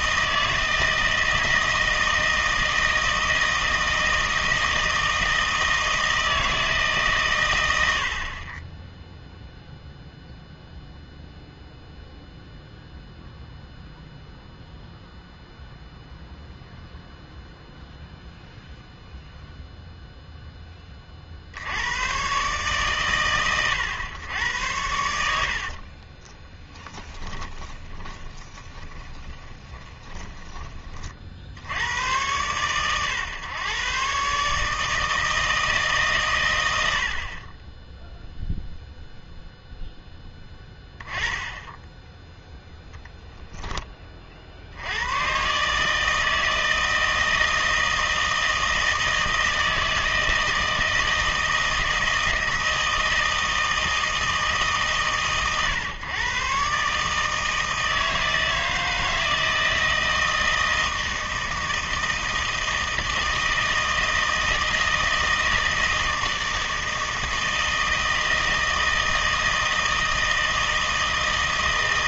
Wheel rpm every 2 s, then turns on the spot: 160, 160, 160, 150, 10, 0, 0, 0, 0, 0, 20, 130, 90, 10, 20, 30, 120, 150, 90, 0, 10, 0, 80, 160, 160, 160, 160, 140, 140, 160, 160, 160, 160, 160, 160, 160.
26-30